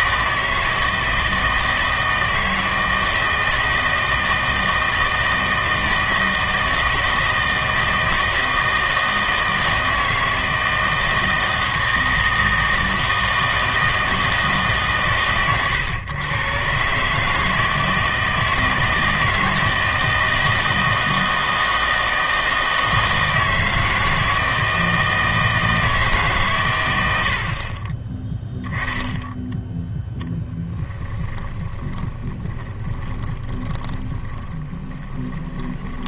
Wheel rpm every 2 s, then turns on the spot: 160, 160, 160, 160, 160, 160, 160, 150, 130, 160, 160, 160, 160, 120, 0, 20, 20, 20.
30-36